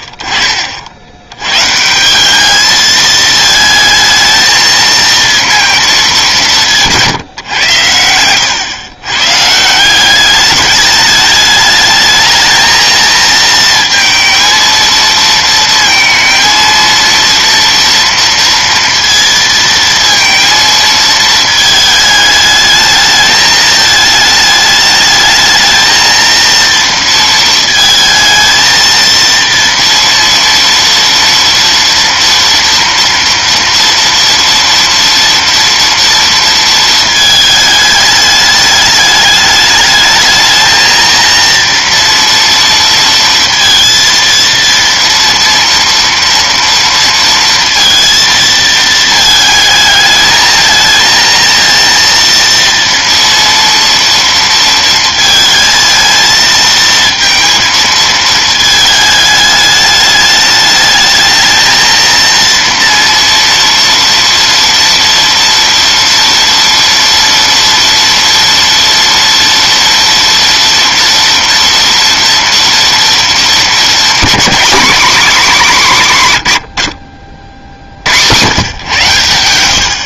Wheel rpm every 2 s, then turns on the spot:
50, 210, 230, 200, 110, 200, 220, 230, 230, 230, 230, 210, 220, 230, 220, 230, 230, 230, 230, 210, 220, 230, 230, 230, 230, 220, 230, 230, 230, 220, 210, 230, 230, 230, 230, 230, 230, 250, 90, 130.
none